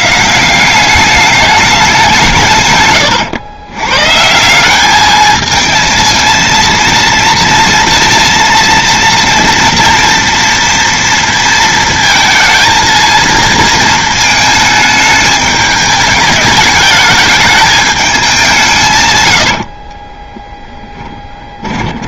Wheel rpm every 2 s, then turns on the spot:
180, 130, 190, 230, 230, 230, 220, 220, 210, 170, 20.
20-22